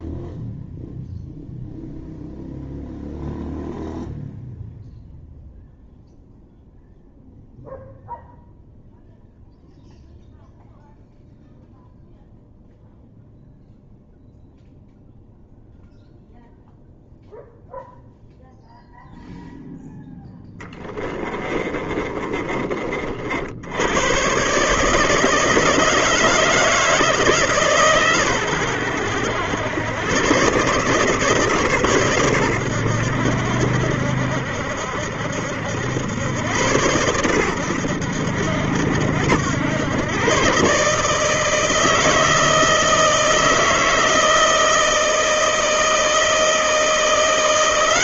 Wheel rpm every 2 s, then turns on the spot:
0, 0, 0, 0, 0, 0, 0, 0, 0, 0, 20, 40, 150, 160, 90, 140, 90, 70, 100, 70, 140, 160, 160, 170.
20-22